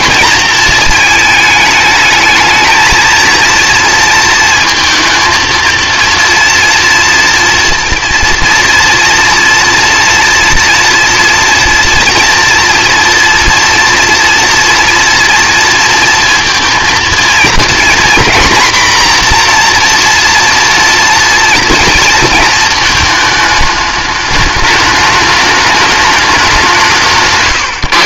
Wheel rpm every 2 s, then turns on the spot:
220, 220, 230, 240, 230, 230, 230, 230, 230, 240, 240, 230, 210, 180.
none